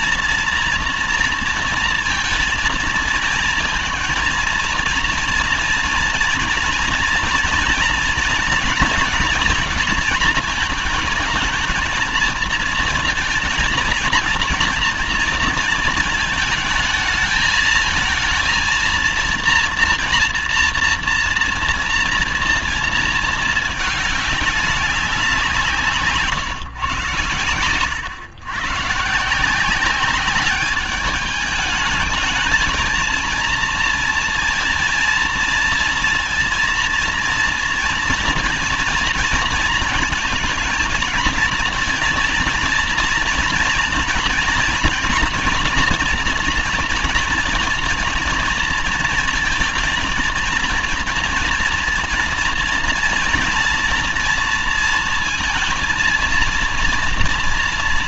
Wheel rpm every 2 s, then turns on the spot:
230, 230, 230, 230, 230, 230, 230, 230, 220, 230, 240, 230, 210, 130, 120, 200, 220, 230, 230, 230, 230, 230, 230, 230, 230, 230, 230, 230, 230.
none